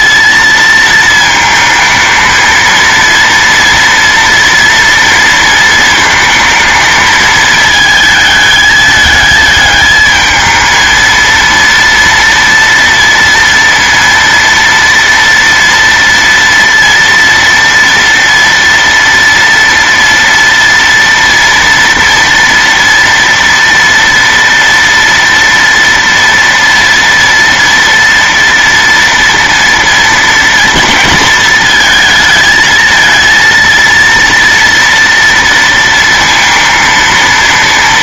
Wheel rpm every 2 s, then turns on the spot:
220, 230, 230, 220, 220, 220, 230, 230, 230, 230, 230, 230, 230, 230, 230, 230, 220, 230, 230.
none